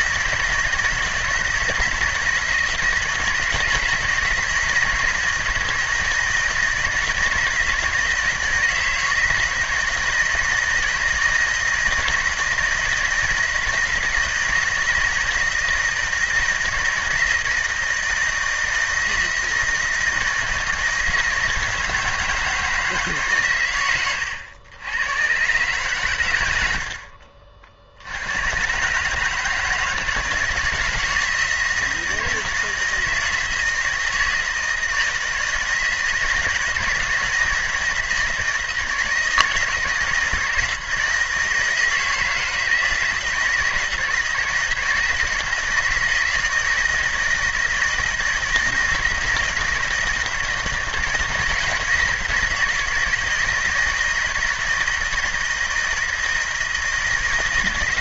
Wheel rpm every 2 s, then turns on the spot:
170, 160, 160, 160, 160, 160, 160, 160, 170, 160, 160, 160, 100, 90, 120, 160, 160, 160, 160, 160, 160, 160, 170, 160, 160, 160, 160, 160, 160.
none